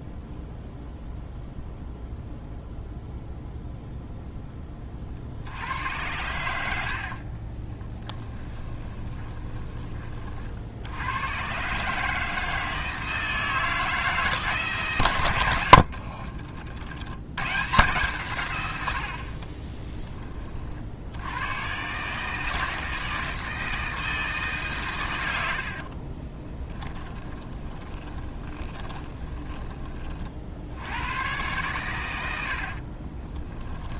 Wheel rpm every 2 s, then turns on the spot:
0, 0, 30, 80, 10, 70, 160, 140, 60, 100, 50, 160, 130, 20, 20, 70, 70.
6-10 26-30 32-34